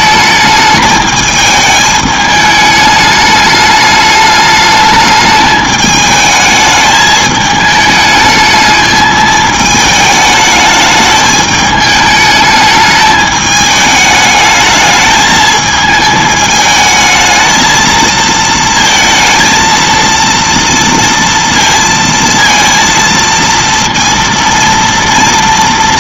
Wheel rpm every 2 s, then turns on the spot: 220, 210, 210, 220, 210, 210, 210, 210, 220, 230, 230, 230, 230.
none